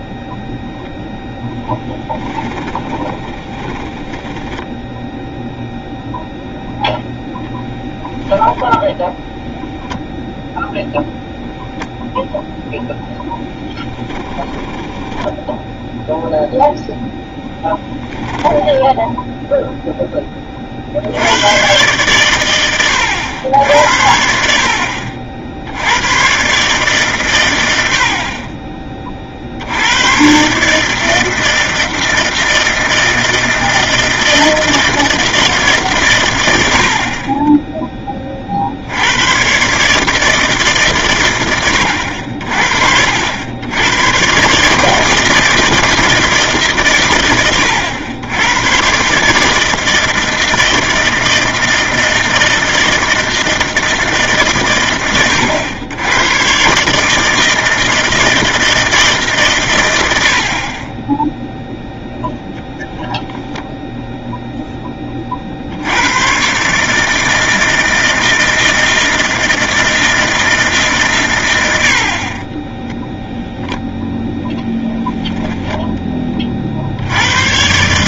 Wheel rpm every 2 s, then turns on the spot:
0, 20, 10, 0, 0, 0, 0, 10, 0, 10, 40, 100, 60, 140, 30, 140, 160, 160, 80, 70, 150, 60, 150, 140, 120, 160, 160, 130, 140, 160, 30, 0, 10, 140, 160, 150, 10, 0, 60.
2-4 14-16 72-74